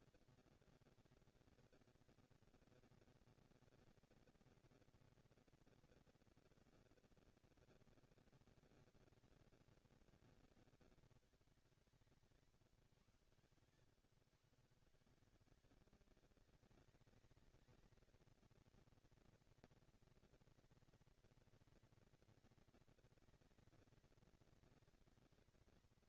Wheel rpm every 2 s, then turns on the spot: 200, 230, 230, 230, 230, 210, 140, 130, 200, 220, 230, 230, 220.
none